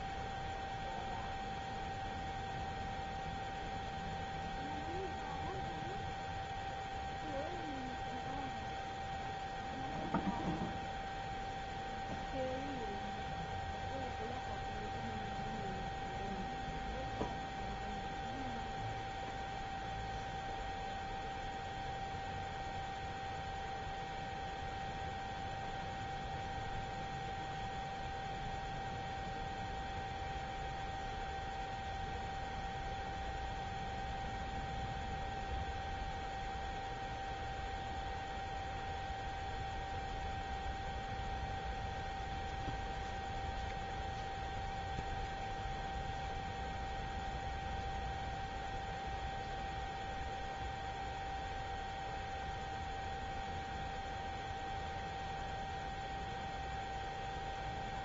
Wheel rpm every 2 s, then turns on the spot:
0, 0, 0, 0, 0, 0, 0, 0, 0, 0, 0, 0, 0, 0, 0, 0, 0, 0, 0, 0, 0, 0, 0, 0, 0, 0, 0, 0, 0.
none